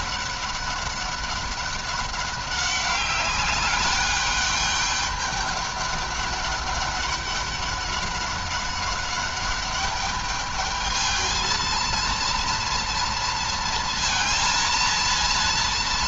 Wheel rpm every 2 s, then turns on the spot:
190, 200, 200, 200, 200, 220, 230, 230.
none